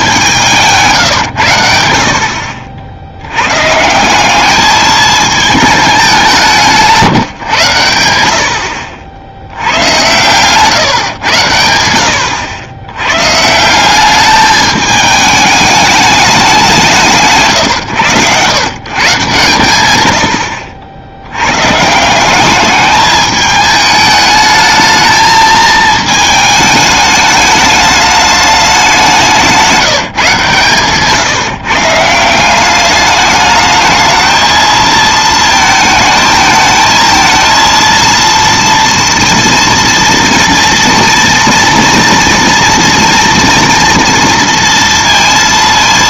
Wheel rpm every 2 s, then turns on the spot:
160, 60, 210, 170, 60, 120, 90, 210, 190, 120, 80, 200, 210, 220, 210, 150, 190, 220, 220, 230, 230, 230, 230.
none